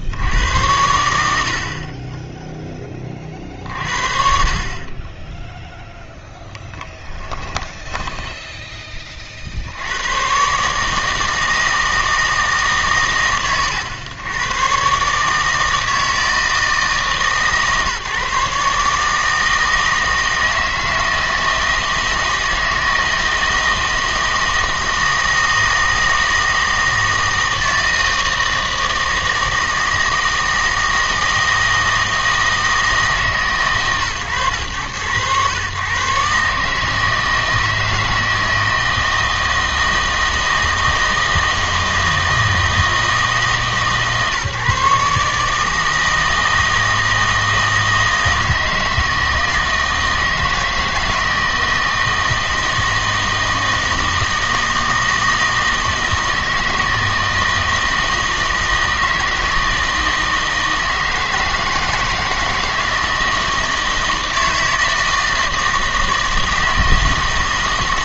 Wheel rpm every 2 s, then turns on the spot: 100, 10, 50, 10, 20, 140, 140, 120, 150, 150, 160, 160, 160, 160, 160, 160, 160, 120, 150, 160, 160, 160, 150, 160, 160, 160, 160, 160, 160, 160, 160, 160, 160, 160.
6-8